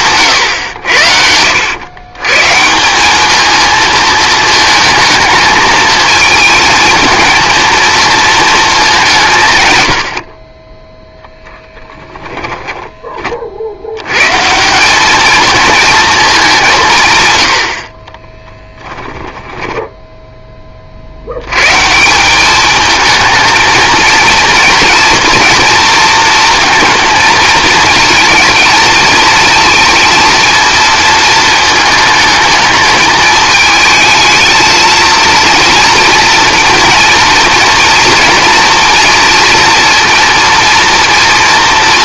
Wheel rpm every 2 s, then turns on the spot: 90, 160, 220, 220, 210, 30, 10, 170, 180, 10, 40, 210, 230, 230, 230, 230, 220, 220, 230, 240, 240.
12-14 18-20